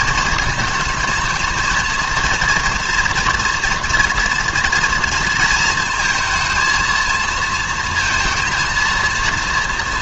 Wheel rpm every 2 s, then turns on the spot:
220, 230, 230, 230, 230.
none